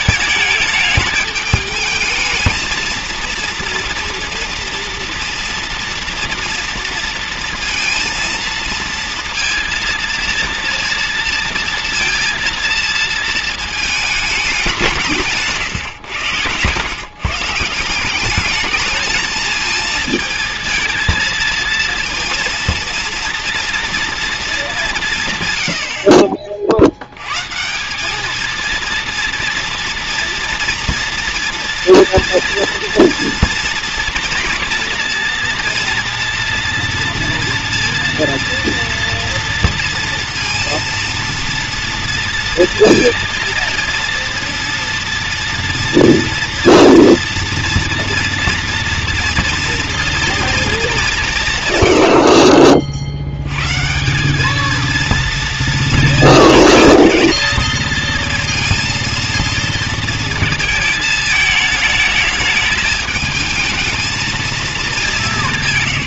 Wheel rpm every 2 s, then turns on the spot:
210, 230, 240, 230, 230, 230, 230, 200, 120, 210, 230, 230, 230, 50, 230, 240, 240, 240, 230, 230, 230, 230, 230, 230, 230, 230, 40, 210, 240, 230, 220, 210, 210.
none